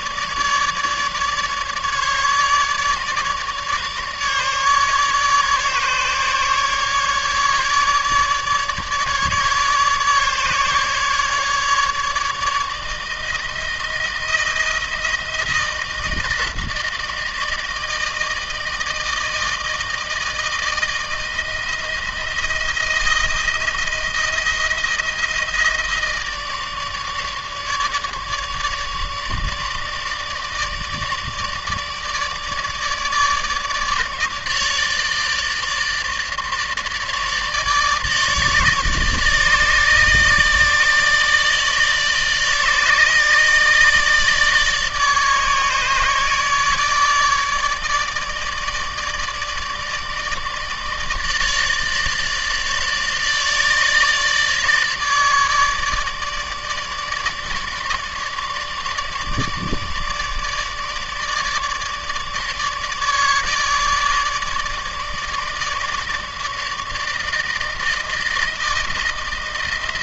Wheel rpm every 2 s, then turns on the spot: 150, 150, 150, 150, 150, 150, 160, 160, 160, 160, 160, 160, 160, 150, 150, 150, 150, 150, 150, 150, 150, 150, 150, 150, 160, 150, 150, 150, 150, 160, 150, 150, 150, 150, 160.
none